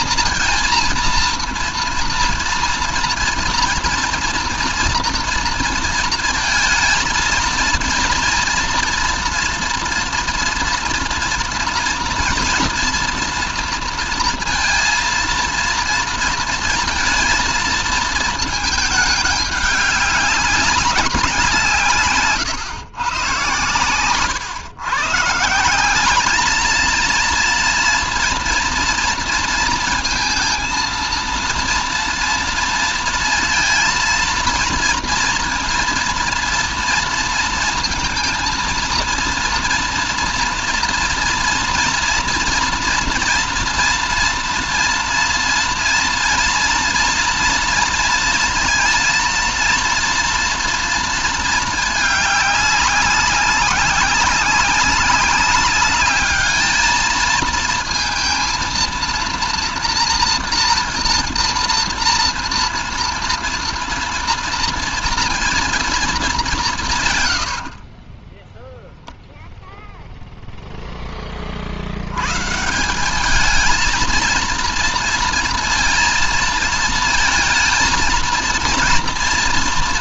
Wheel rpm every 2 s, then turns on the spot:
230, 230, 230, 230, 230, 230, 230, 230, 230, 210, 190, 130, 140, 220, 230, 230, 230, 230, 230, 230, 230, 230, 230, 240, 230, 230, 190, 200, 220, 230, 230, 230, 230, 170, 0, 0, 170, 230, 230, 230.
none